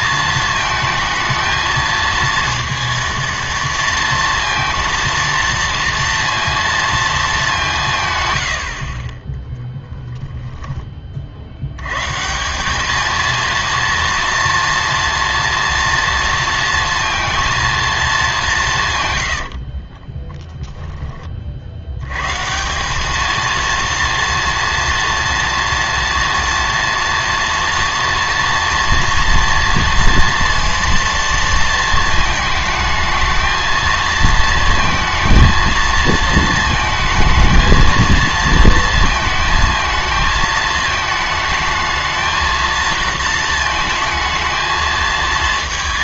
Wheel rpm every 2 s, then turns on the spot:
220, 230, 230, 230, 80, 10, 200, 230, 230, 160, 10, 180, 230, 230, 230, 230, 220, 220, 220, 230, 220, 220, 220.
none